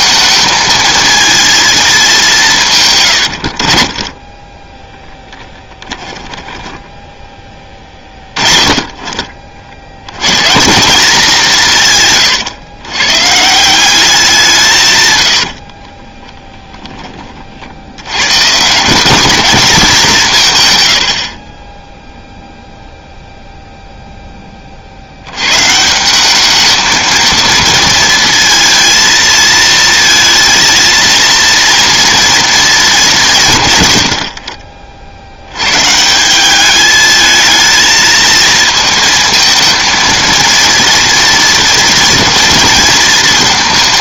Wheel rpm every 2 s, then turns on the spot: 220, 140, 10, 10, 30, 170, 120, 160, 10, 160, 110, 0, 40, 220, 230, 230, 220, 60, 210, 220, 230, 230.
4-8